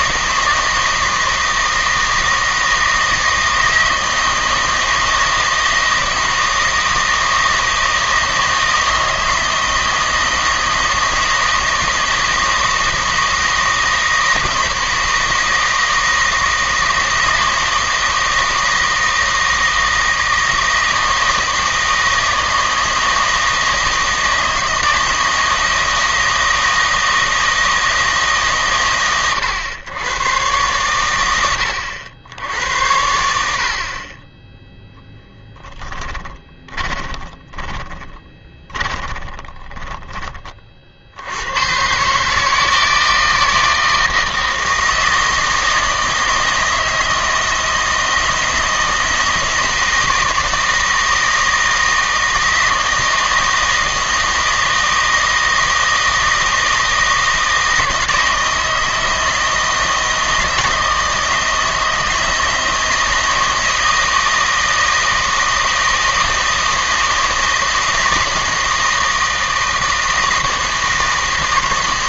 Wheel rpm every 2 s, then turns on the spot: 160, 160, 160, 160, 160, 160, 160, 160, 160, 160, 160, 160, 160, 160, 130, 110, 70, 10, 20, 20, 40, 160, 160, 160, 160, 160, 160, 160, 160, 160, 160, 160, 160, 160, 160, 160.
36-40